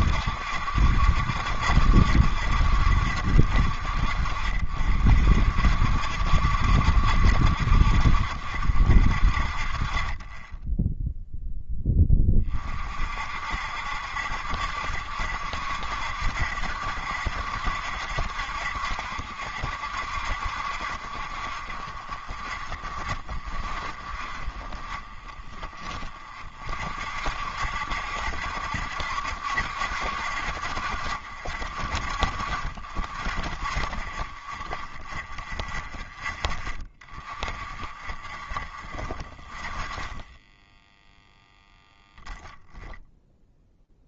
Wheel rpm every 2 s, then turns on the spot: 70, 70, 60, 60, 60, 20, 30, 70, 70, 70, 60, 40, 30, 40, 60, 60, 60, 30, 10, 30, 10, 0.
none